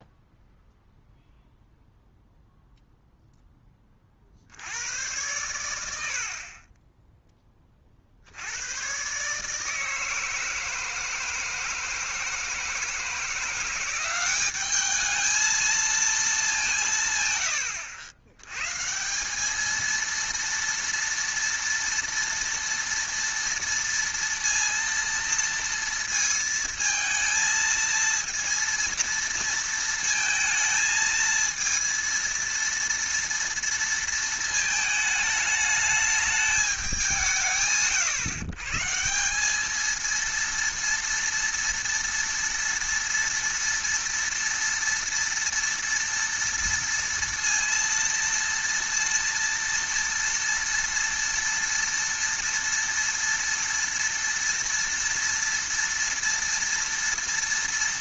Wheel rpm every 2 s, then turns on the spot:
0, 0, 80, 30, 100, 160, 160, 200, 190, 120, 230, 230, 230, 220, 230, 230, 230, 220, 210, 130, 230, 230, 230, 230, 230, 230, 240, 230, 230.
none